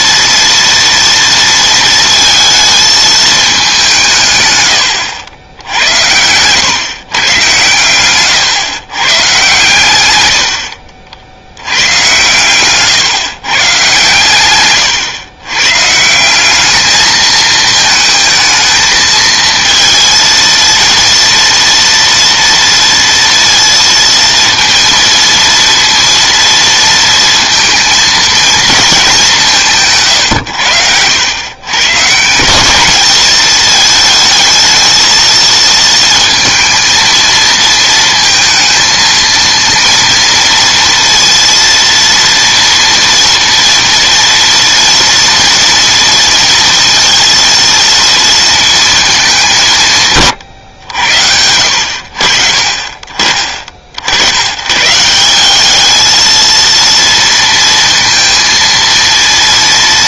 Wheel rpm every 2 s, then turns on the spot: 230, 220, 110, 120, 130, 80, 140, 130, 200, 220, 230, 230, 230, 230, 220, 80, 190, 220, 230, 230, 230, 230, 230, 230, 230, 120, 50, 130, 230, 230.
14-16 30-32